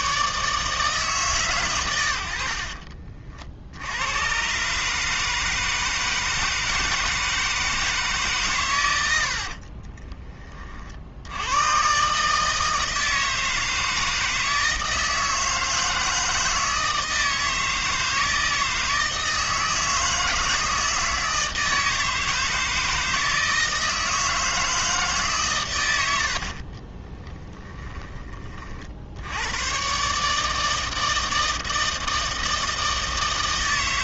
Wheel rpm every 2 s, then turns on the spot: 150, 50, 140, 160, 120, 40, 160, 160, 160, 160, 160, 160, 160, 40, 40, 160, 160.
26-28